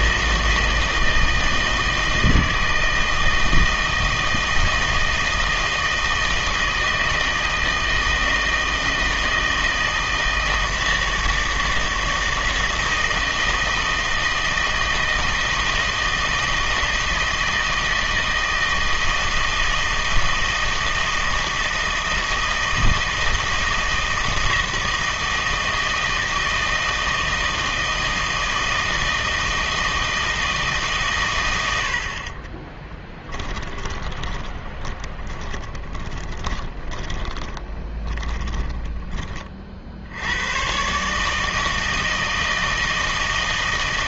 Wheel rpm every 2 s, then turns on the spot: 160, 160, 160, 160, 160, 160, 160, 160, 160, 160, 160, 160, 160, 160, 160, 150, 20, 20, 20, 10, 130, 160.
32-40